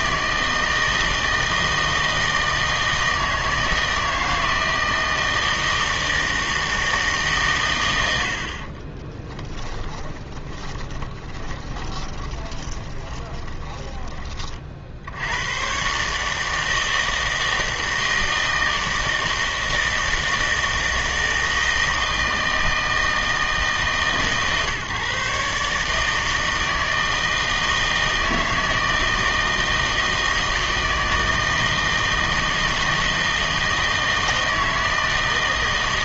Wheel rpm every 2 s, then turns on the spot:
160, 160, 160, 160, 30, 20, 20, 50, 160, 160, 160, 160, 140, 160, 160, 160, 160, 160.
8-14